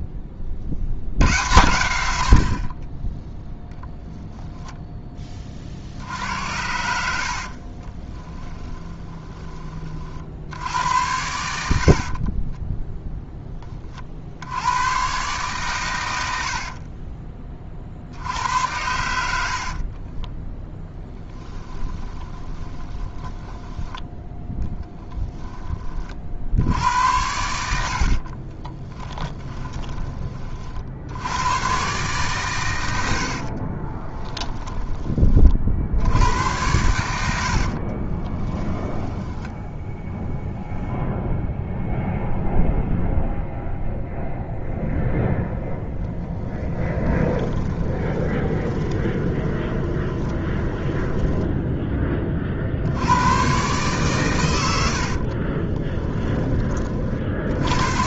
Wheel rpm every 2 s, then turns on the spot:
30, 60, 10, 80, 20, 70, 20, 80, 60, 80, 10, 20, 10, 60, 40, 40, 130, 20, 90, 20, 0, 0, 0, 10, 20, 20, 40, 110, 20.
8-10 12-14 16-18 20-24 28-30 34-36 38-40 46-52